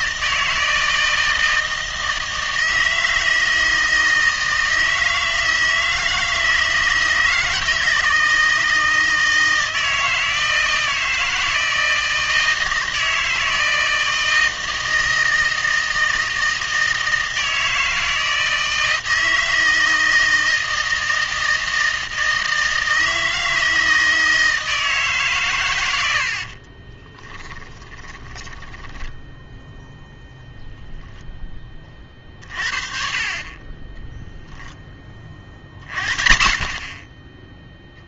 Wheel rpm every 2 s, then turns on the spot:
160, 160, 160, 160, 160, 160, 160, 160, 160, 160, 160, 160, 160, 40, 10, 0, 40, 10, 40.
26-30